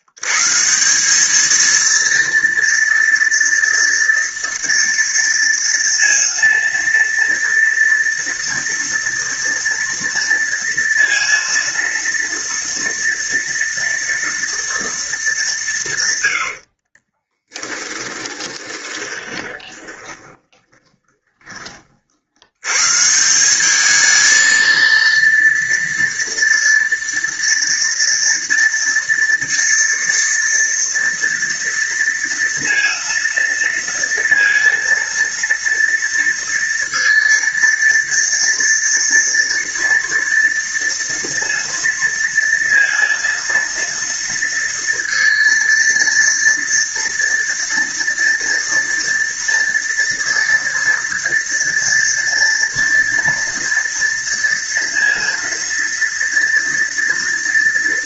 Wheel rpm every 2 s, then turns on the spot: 130, 230, 230, 230, 230, 230, 230, 230, 100, 20, 20, 80, 220, 230, 230, 230, 230, 230, 230, 230, 230, 230, 230, 230, 230, 230, 230, 230, 230.
18-22